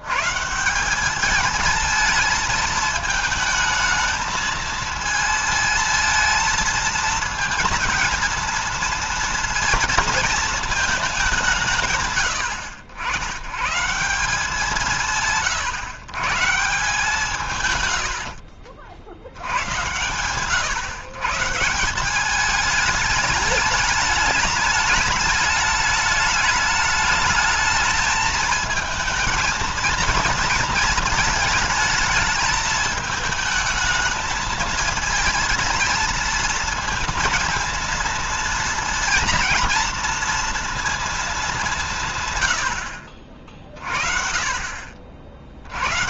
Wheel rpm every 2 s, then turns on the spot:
160, 220, 220, 220, 230, 230, 100, 170, 150, 70, 120, 210, 210, 210, 220, 230, 220, 220, 230, 230, 230, 90, 50.
18-20